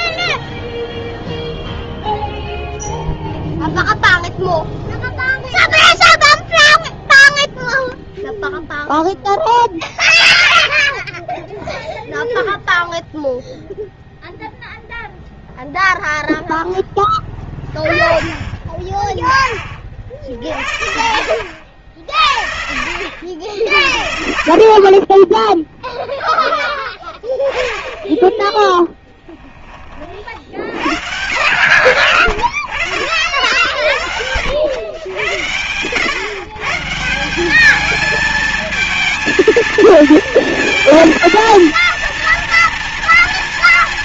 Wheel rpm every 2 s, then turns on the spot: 0, 0, 0, 0, 0, 0, 0, 0, 0, 10, 50, 60, 30, 10, 10, 70, 40, 90, 160, 220, 230, 230.
none